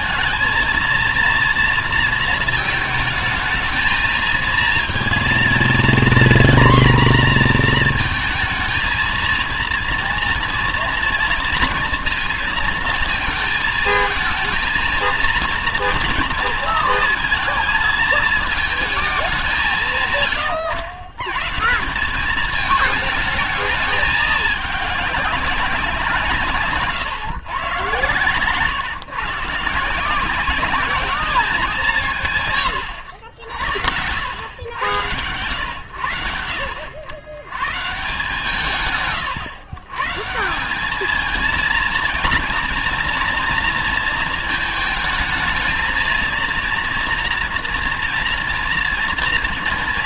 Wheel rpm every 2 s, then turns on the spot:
230, 230, 220, 240, 230, 230, 230, 220, 230, 220, 110, 200, 220, 160, 130, 190, 150, 100, 90, 140, 170, 230, 220, 230, 230.
none